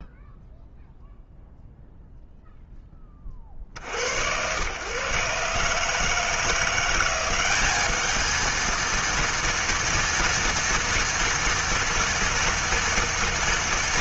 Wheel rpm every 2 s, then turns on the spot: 0, 0, 120, 170, 220, 230, 230.
none